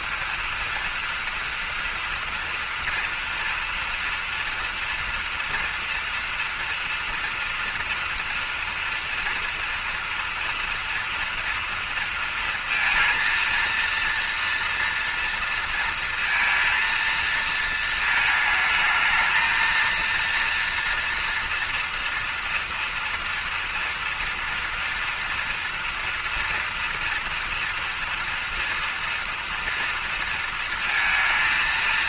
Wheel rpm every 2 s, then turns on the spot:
230, 230, 230, 240, 240, 240, 230, 230, 230, 220, 230, 230, 230, 230, 230, 230.
none